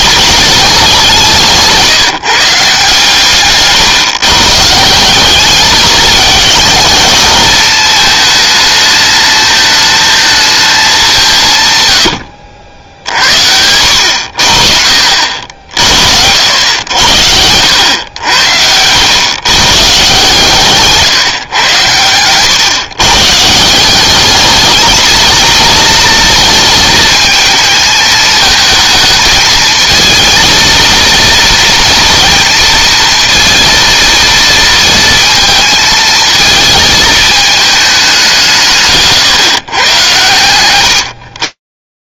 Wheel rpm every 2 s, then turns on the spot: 200, 140, 170, 220, 220, 210, 70, 70, 90, 90, 140, 130, 220, 220, 220, 230, 230, 220, 220, 150, 110.
none